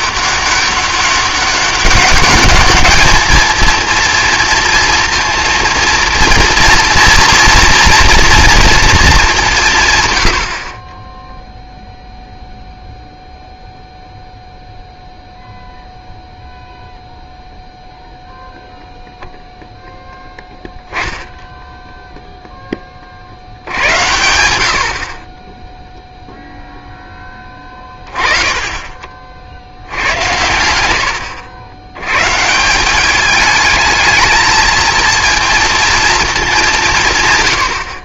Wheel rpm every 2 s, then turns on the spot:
200, 210, 230, 230, 240, 60, 0, 0, 0, 0, 0, 10, 70, 0, 20, 80, 160, 220, 180.
none